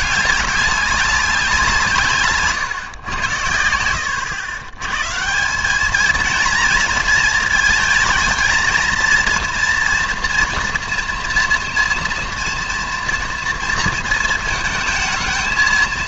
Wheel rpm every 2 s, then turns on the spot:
200, 130, 110, 230, 220, 240, 230, 230.
none